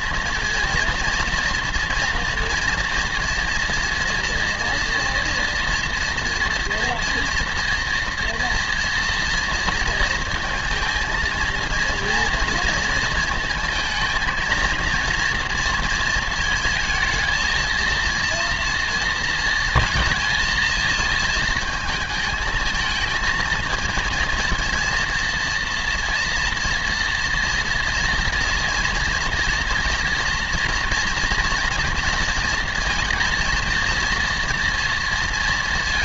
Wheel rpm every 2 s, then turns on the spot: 230, 230, 230, 240, 230, 220, 230, 230, 220, 230, 220, 220, 230, 230, 230, 230, 230, 230.
none